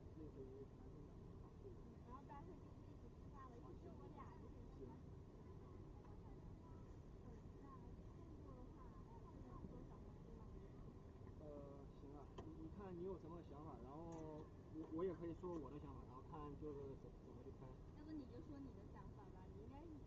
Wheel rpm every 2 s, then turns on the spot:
0, 0, 0, 0, 0, 0, 0, 0, 0, 0.
none